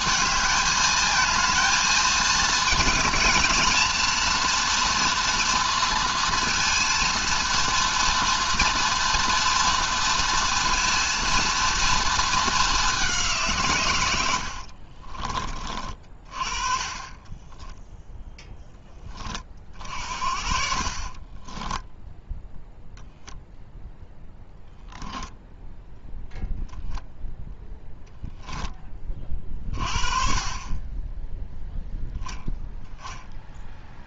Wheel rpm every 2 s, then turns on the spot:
220, 220, 240, 230, 230, 240, 200, 50, 30, 20, 40, 0, 0, 0, 30, 20, 10.
14-16 20-22